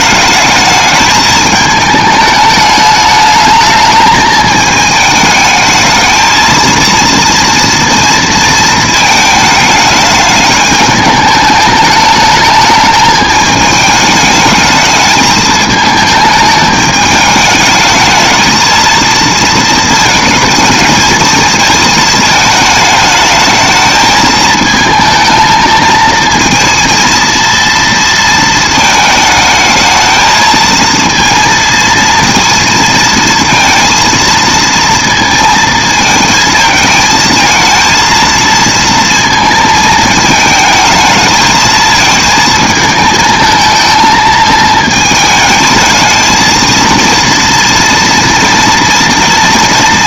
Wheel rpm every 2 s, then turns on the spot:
220, 210, 210, 230, 220, 210, 220, 220, 210, 230, 220, 220, 220, 230, 220, 230, 230, 230, 220, 230, 220, 220, 220, 230, 230.
none